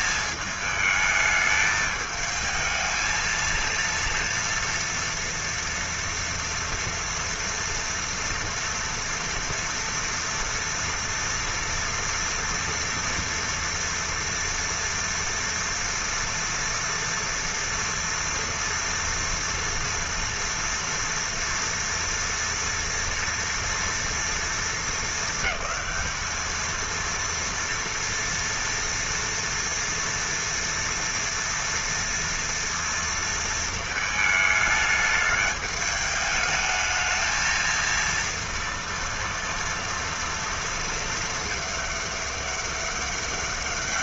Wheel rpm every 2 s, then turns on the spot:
220, 220, 230, 230, 230, 230, 230, 230, 240, 230, 240, 230, 230, 220, 230, 230, 230, 210, 220, 230, 230, 200.
none